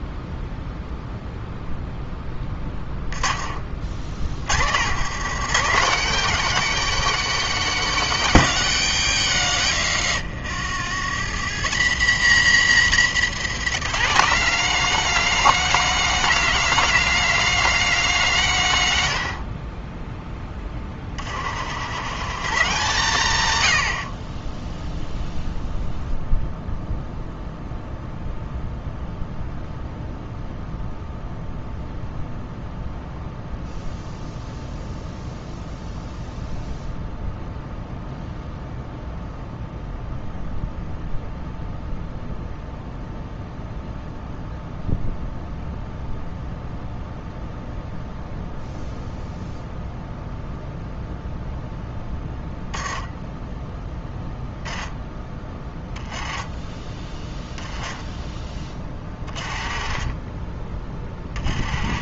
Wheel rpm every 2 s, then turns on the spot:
0, 20, 80, 220, 150, 80, 140, 200, 220, 150, 20, 140, 0, 0, 0, 0, 0, 0, 0, 0, 0, 0, 0, 0, 0, 0, 0, 10, 20, 20, 30.
20-22